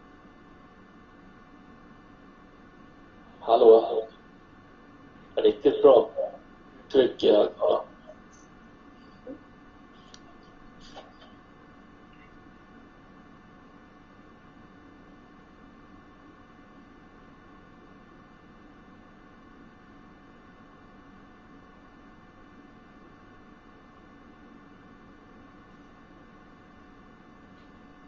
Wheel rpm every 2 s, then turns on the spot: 0, 0, 0, 0, 0, 0, 0, 0, 0, 0, 0, 0, 0, 0.
none